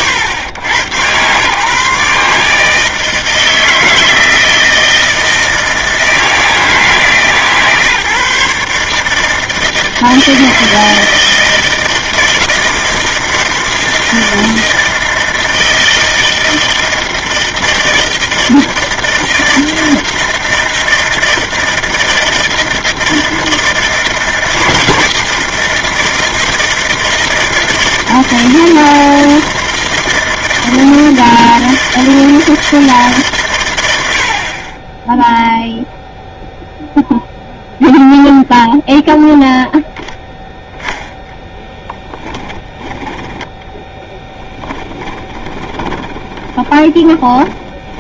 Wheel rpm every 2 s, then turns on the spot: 110, 160, 160, 150, 150, 160, 160, 160, 160, 160, 160, 160, 160, 160, 160, 160, 160, 20, 0, 0, 0, 10, 20, 20.
44-48